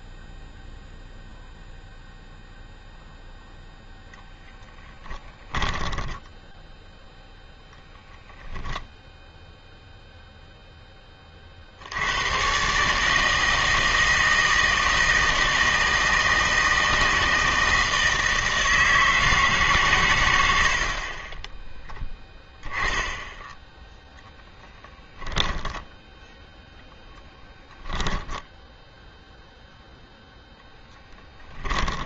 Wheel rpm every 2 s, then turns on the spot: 0, 0, 10, 0, 10, 10, 140, 160, 160, 160, 50, 10, 10, 0, 0, 10.
24-26 30-32